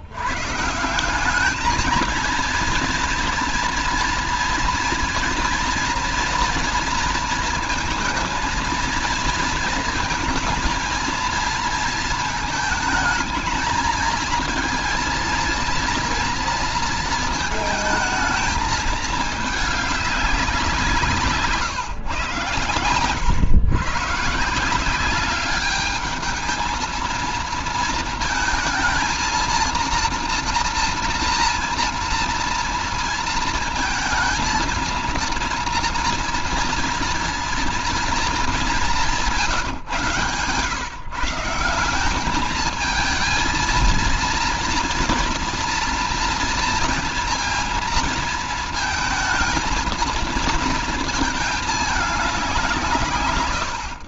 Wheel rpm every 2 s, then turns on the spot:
130, 230, 230, 230, 220, 220, 220, 230, 240, 220, 190, 110, 150, 220, 230, 230, 230, 230, 230, 220, 140, 210, 230, 230, 230, 230, 190.
none